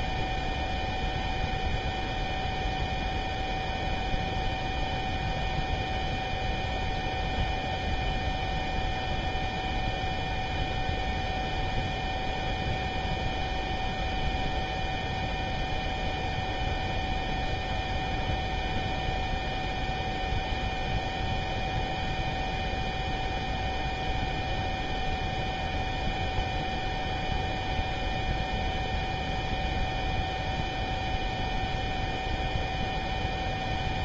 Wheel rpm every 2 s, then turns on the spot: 0, 0, 0, 0, 0, 0, 0, 0, 0, 0, 0, 0, 0, 0, 0, 0, 0.
none